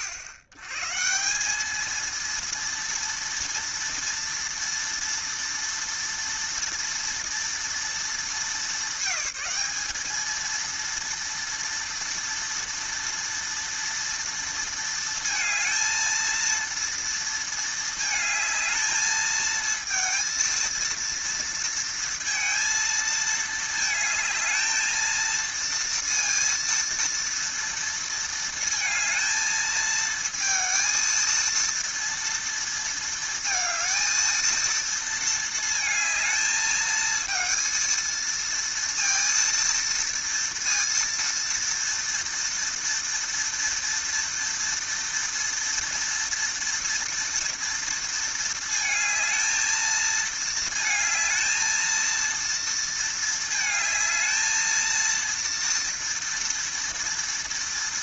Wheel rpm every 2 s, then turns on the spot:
100, 230, 230, 230, 220, 230, 230, 230, 230, 220, 230, 230, 220, 230, 230, 230, 230, 230, 220, 230, 230, 230, 230, 230, 220, 220, 230, 230, 230.
none